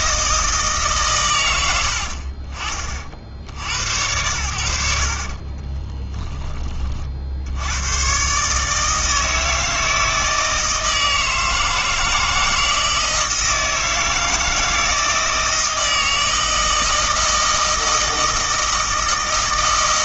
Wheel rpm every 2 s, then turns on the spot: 150, 40, 70, 30, 150, 160, 160, 160, 160, 160.
4-6